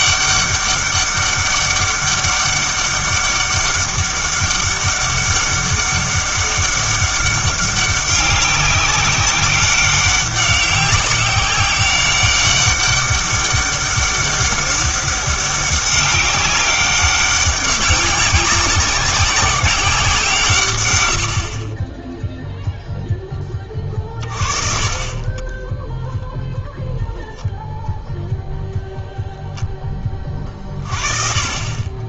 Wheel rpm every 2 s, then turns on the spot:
200, 200, 200, 200, 190, 190, 200, 200, 200, 190, 130, 0, 30, 0, 0, 40.
24-26